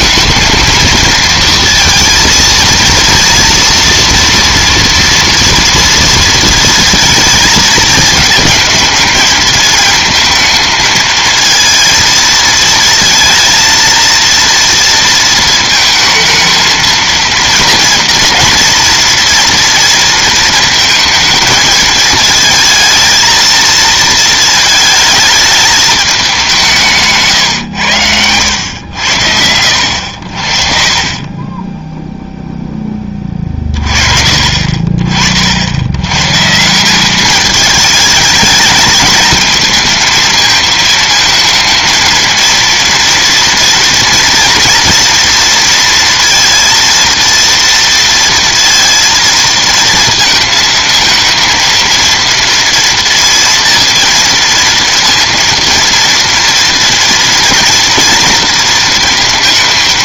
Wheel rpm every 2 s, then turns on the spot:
220, 230, 230, 230, 220, 220, 220, 230, 230, 230, 230, 220, 220, 200, 100, 50, 0, 40, 150, 220, 230, 230, 230, 230, 230, 220, 230, 230, 230, 230.
none